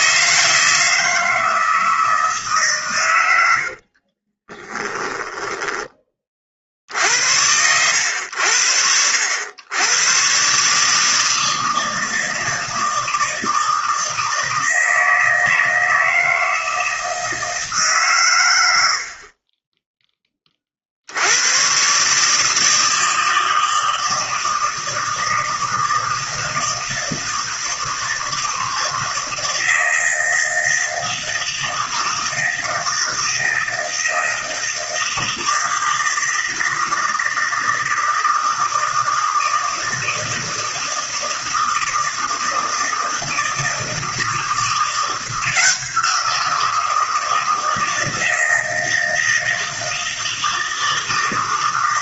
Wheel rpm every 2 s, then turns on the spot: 130, 20, 40, 80, 150, 160, 160, 160, 80, 30, 160, 160, 160, 160, 160, 160, 160, 160, 160, 160, 160, 170, 170, 160, 160, 160.
2-4